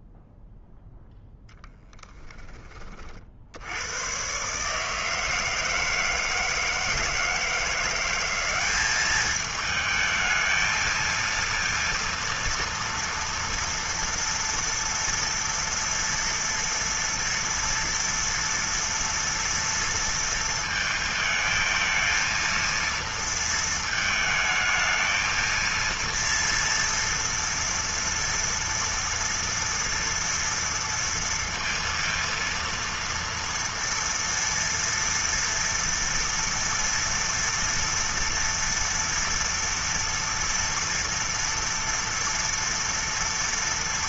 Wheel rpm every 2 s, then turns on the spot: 0, 10, 120, 160, 180, 220, 230, 230, 230, 230, 230, 230, 220, 230, 230, 240, 230, 230, 230, 230, 230, 230.
none